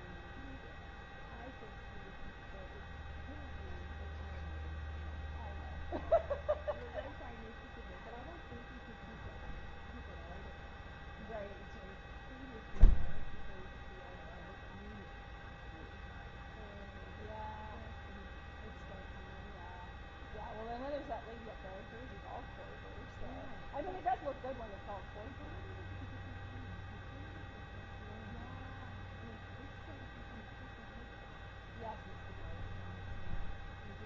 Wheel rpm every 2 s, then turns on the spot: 0, 0, 0, 0, 0, 0, 0, 0, 0, 0, 0, 0, 0, 0, 0, 0, 0.
none